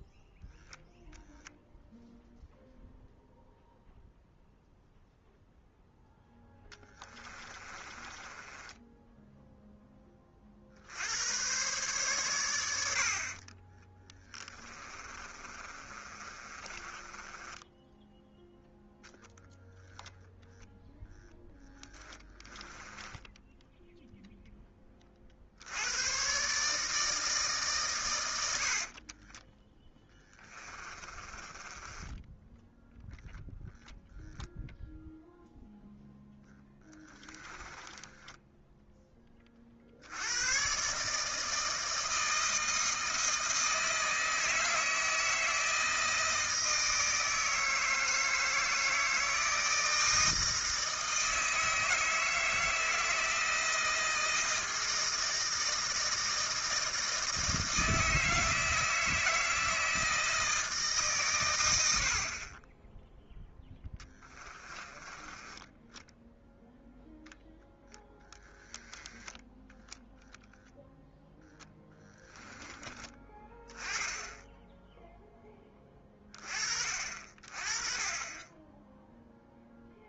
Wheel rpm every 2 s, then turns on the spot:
0, 0, 0, 10, 10, 60, 90, 30, 30, 0, 0, 10, 10, 140, 70, 20, 0, 0, 10, 10, 120, 160, 160, 160, 160, 160, 160, 160, 160, 160, 160, 20, 20, 0, 10, 0, 10, 10, 40, 20.
6-10 14-18 22-24 28-32 36-40 64-66 68-70